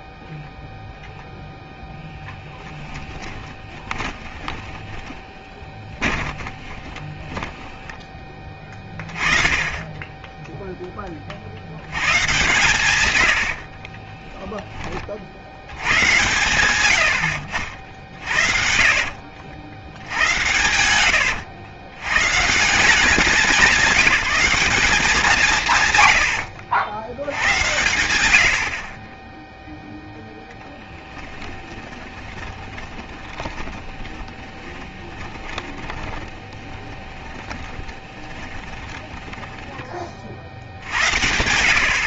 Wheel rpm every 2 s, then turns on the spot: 0, 10, 20, 20, 20, 10, 130, 0, 110, 60, 110, 170, 200, 80, 70, 0, 20, 10, 10, 20, 60.
4-8 18-20 26-28 32-40